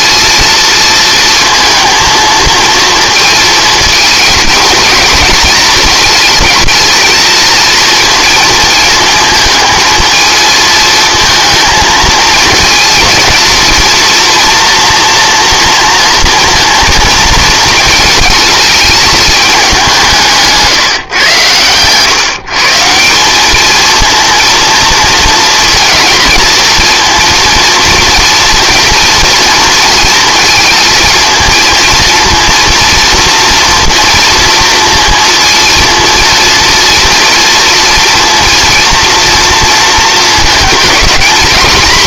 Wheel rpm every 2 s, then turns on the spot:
230, 220, 220, 220, 230, 220, 220, 230, 230, 220, 150, 160, 230, 230, 230, 230, 230, 230, 230, 230, 220.
none